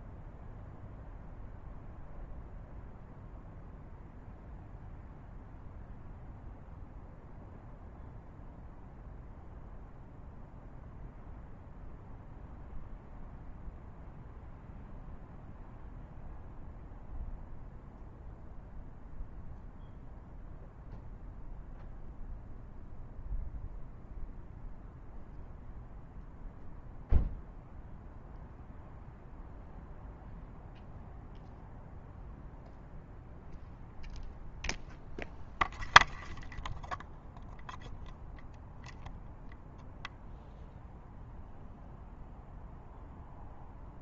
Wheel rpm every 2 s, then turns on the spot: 0, 0, 0, 0, 0, 0, 0, 0, 0, 0, 0, 0, 0, 0, 0, 0, 0, 0, 0, 0, 0, 0.
none